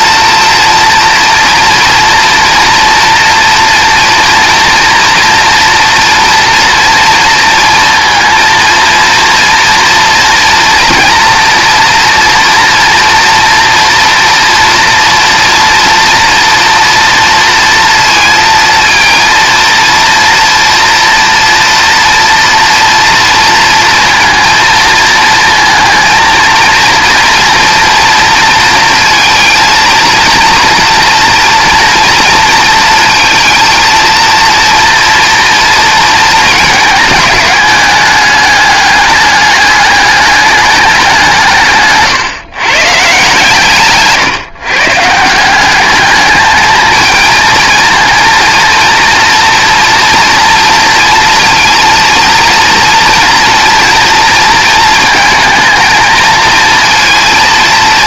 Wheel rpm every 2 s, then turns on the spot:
230, 230, 230, 230, 230, 230, 240, 230, 230, 230, 240, 240, 230, 230, 230, 230, 230, 230, 220, 210, 200, 140, 140, 220, 230, 230, 230, 220, 230.
none